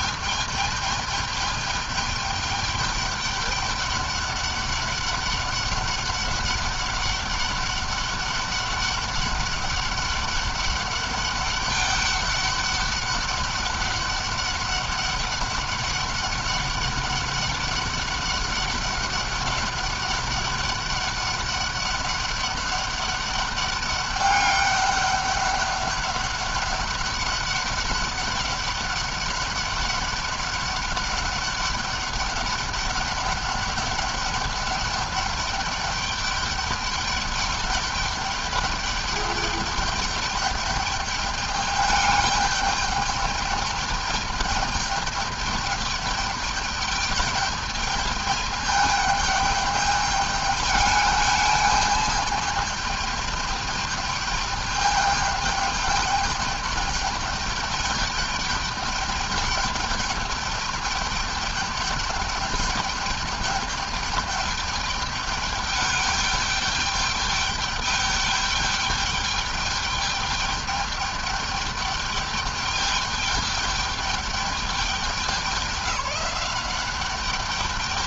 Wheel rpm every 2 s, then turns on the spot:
210, 200, 200, 200, 200, 200, 200, 200, 200, 200, 200, 200, 200, 200, 200, 200, 200, 200, 200, 200, 210, 210, 210, 200, 210, 210, 210, 210, 210, 210, 200, 210, 210, 210, 210, 210, 210, 200, 190.
none